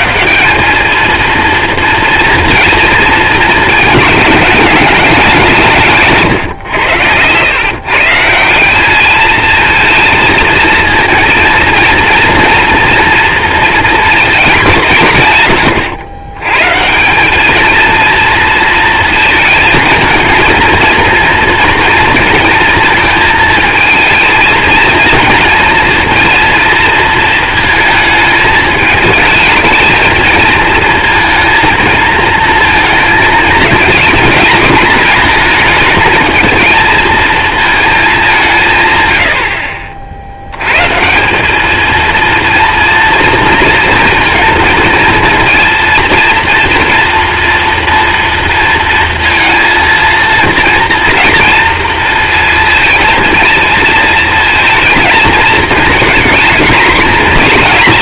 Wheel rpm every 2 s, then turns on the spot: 200, 230, 190, 120, 190, 230, 230, 180, 140, 230, 230, 220, 230, 230, 220, 220, 230, 220, 230, 170, 100, 230, 230, 230, 230, 230, 230, 230, 230.
none